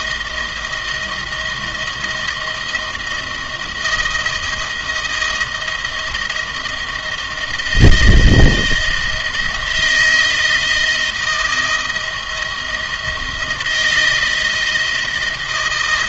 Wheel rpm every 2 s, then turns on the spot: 160, 160, 160, 160, 160, 170, 160, 160.
none